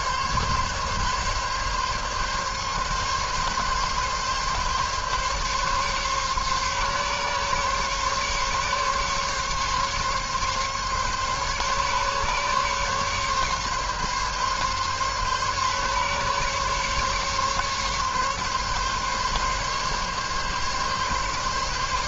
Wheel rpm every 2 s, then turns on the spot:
140, 140, 140, 140, 140, 140, 140, 140, 140, 140, 140.
none